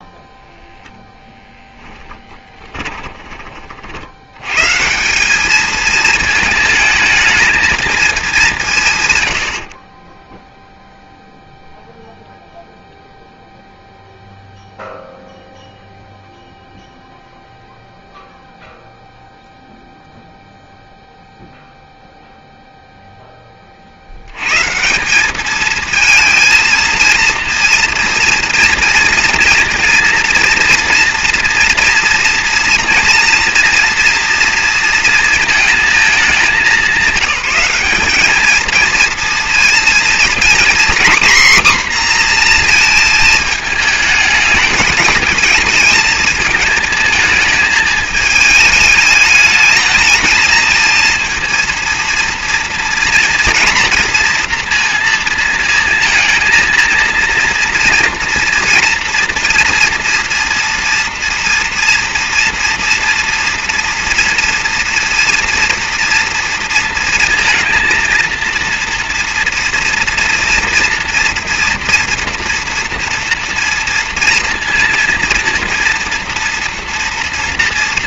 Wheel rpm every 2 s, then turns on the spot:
0, 20, 130, 220, 160, 0, 0, 0, 0, 0, 0, 0, 140, 220, 230, 230, 230, 230, 200, 220, 250, 240, 210, 230, 220, 230, 240, 230, 230, 230, 230, 230, 230, 230, 230, 240, 230, 230, 230.
2-4